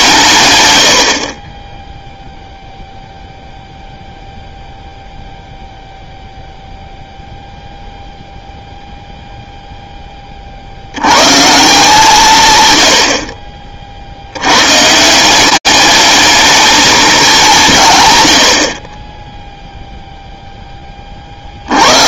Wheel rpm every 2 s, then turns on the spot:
20, 0, 0, 0, 0, 150, 40, 200, 190, 0, 80.
none